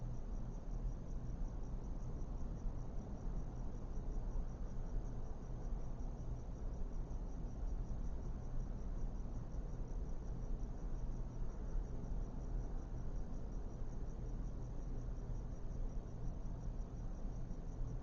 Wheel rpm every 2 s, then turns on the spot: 0, 0, 0, 0, 0, 0, 0, 0, 0.
none